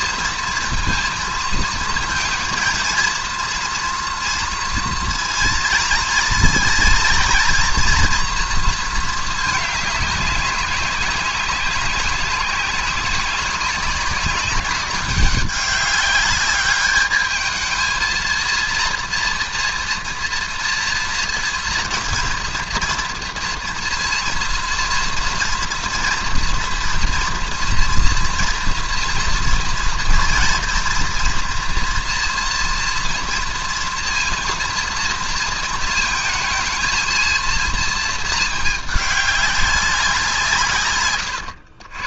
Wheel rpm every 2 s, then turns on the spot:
230, 220, 230, 240, 230, 190, 190, 190, 200, 230, 230, 230, 230, 240, 230, 230, 230, 230, 220, 210, 150.
none